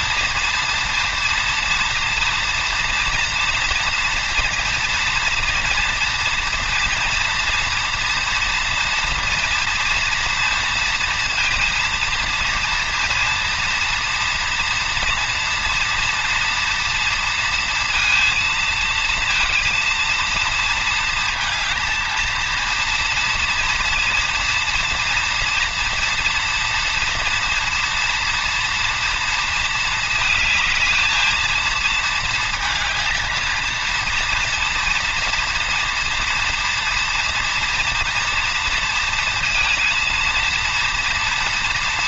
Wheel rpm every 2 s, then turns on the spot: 230, 240, 230, 230, 230, 230, 230, 230, 230, 220, 230, 230, 230, 230, 230, 220, 220, 240, 230, 230, 230.
none